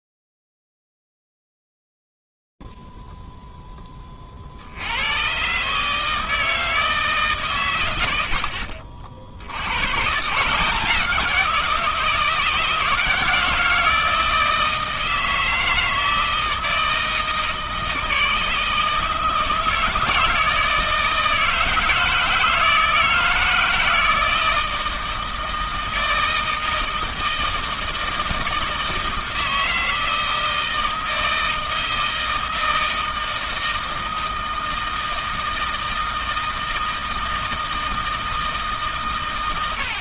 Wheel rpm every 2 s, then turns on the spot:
30, 50, 10, 140, 120, 110, 170, 160, 160, 160, 160, 160, 160, 160, 160, 160, 160, 160, 160, 160.
none